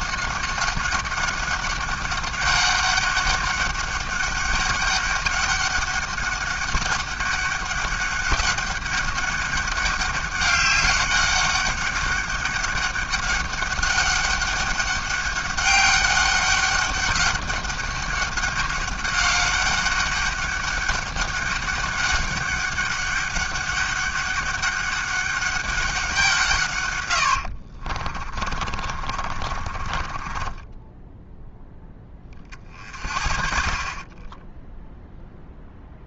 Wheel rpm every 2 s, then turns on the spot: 200, 200, 200, 200, 200, 200, 200, 200, 200, 200, 200, 200, 200, 140, 30, 10, 40, 10.
28-32